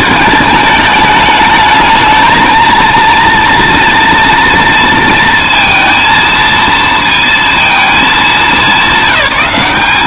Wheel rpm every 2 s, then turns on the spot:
220, 230, 230, 230, 200.
none